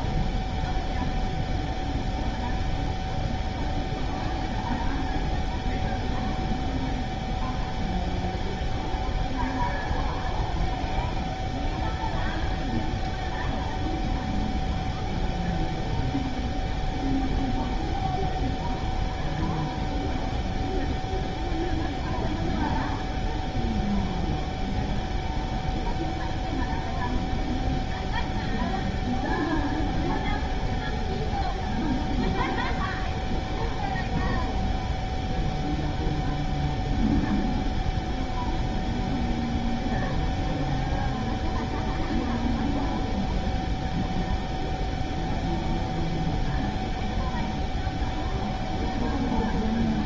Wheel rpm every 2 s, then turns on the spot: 0, 0, 0, 0, 0, 0, 0, 0, 0, 0, 0, 0, 0, 0, 0, 0, 0, 0, 0, 0, 0, 0, 0, 0, 0.
none